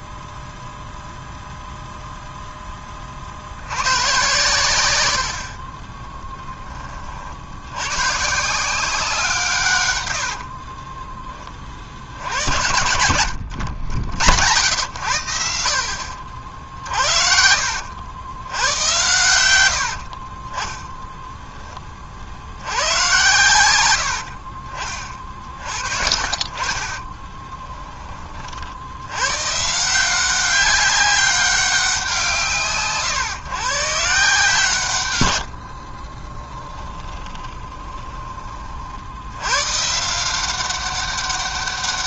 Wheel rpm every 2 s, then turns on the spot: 0, 30, 100, 30, 180, 20, 100, 100, 60, 100, 10, 100, 40, 40, 80, 200, 130, 130, 20, 60, 190.
12-14 26-28 36-38